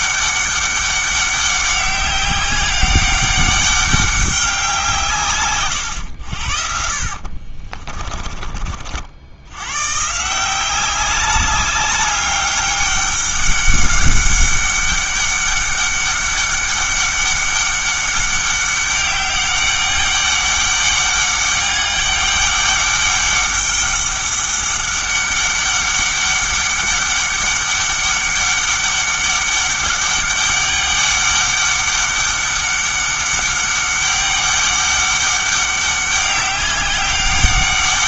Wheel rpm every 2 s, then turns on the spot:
200, 190, 180, 60, 40, 180, 200, 200, 200, 200, 200, 200, 200, 200, 200, 200, 200, 200, 200.
none